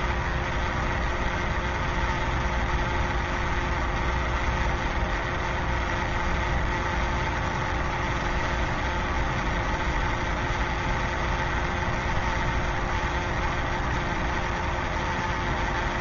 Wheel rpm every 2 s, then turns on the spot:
0, 0, 0, 0, 0, 0, 0, 0.
none